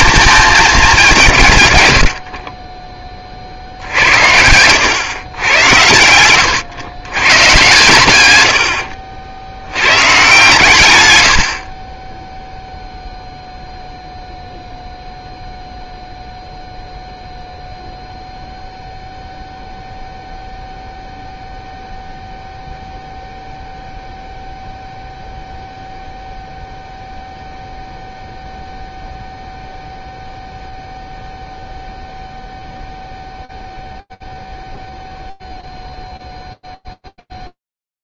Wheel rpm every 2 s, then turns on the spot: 210, 30, 110, 100, 80, 130, 0, 0, 0, 0, 0, 0, 0, 0, 0, 0, 0, 0, 0.
2-4